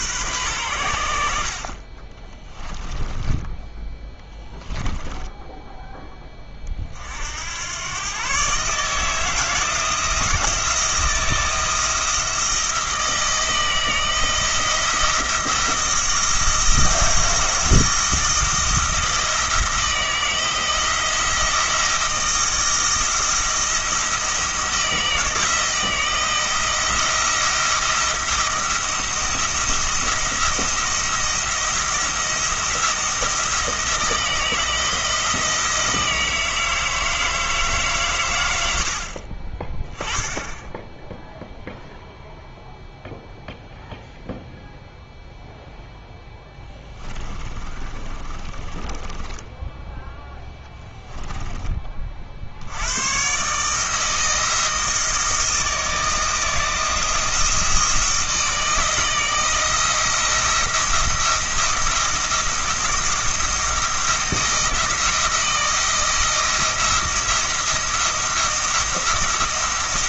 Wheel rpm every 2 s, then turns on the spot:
90, 10, 10, 50, 150, 160, 160, 170, 160, 160, 170, 170, 170, 170, 170, 170, 170, 170, 160, 80, 10, 0, 0, 10, 30, 10, 60, 160, 160, 160, 170, 170, 160, 160, 170.
2-6 46-52